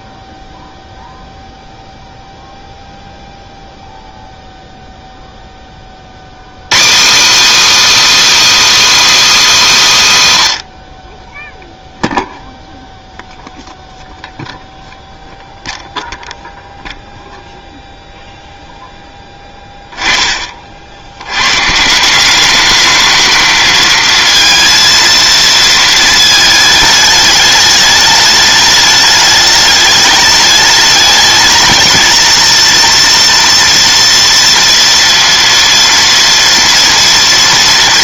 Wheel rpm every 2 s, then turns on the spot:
0, 0, 0, 180, 340, 110, 0, 0, 0, 0, 50, 210, 230, 210, 210, 210, 230, 230, 230.
none